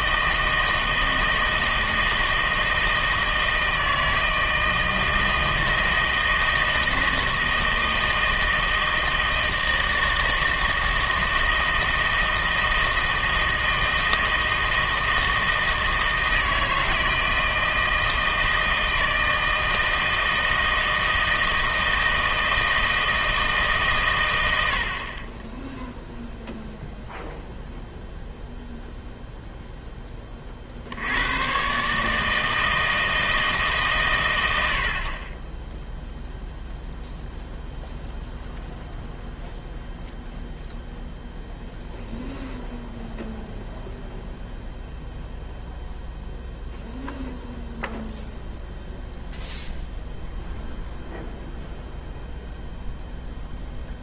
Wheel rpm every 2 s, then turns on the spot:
160, 160, 160, 160, 160, 160, 160, 160, 160, 160, 160, 160, 70, 0, 0, 60, 160, 80, 0, 0, 0, 0, 0, 0, 0, 0, 0.
none